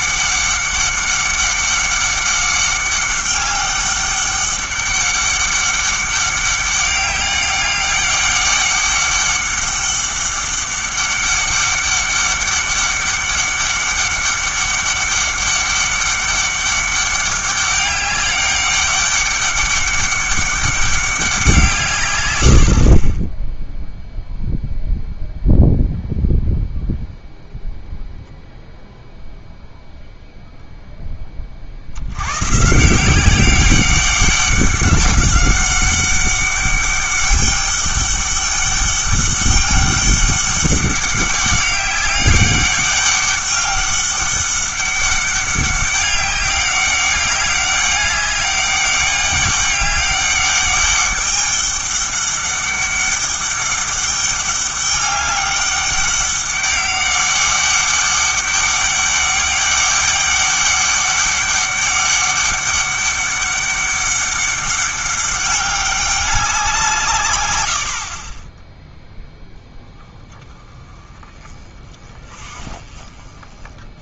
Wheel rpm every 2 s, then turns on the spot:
200, 200, 200, 200, 200, 200, 200, 200, 200, 200, 200, 70, 0, 0, 0, 0, 140, 200, 200, 200, 200, 200, 200, 200, 200, 200, 200, 200, 200, 200, 200, 200, 200, 180, 10, 20, 30.
none